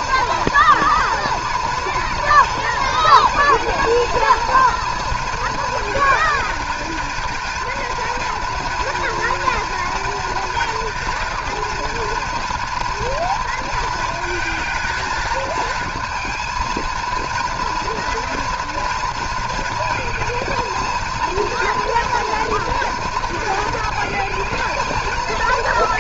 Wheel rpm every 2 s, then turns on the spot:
240, 230, 230, 220, 230, 230, 230, 230, 230, 240, 220, 230, 220.
none